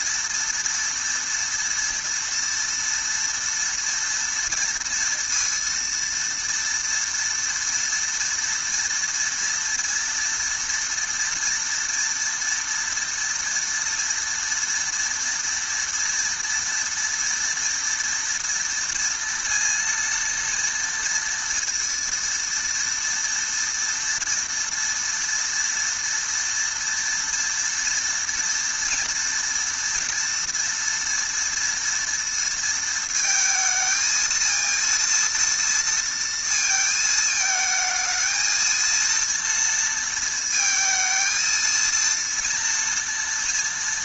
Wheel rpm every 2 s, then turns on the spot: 230, 230, 230, 230, 230, 230, 230, 230, 230, 230, 230, 230, 230, 230, 230, 230, 220, 230, 220, 230, 220, 230.
none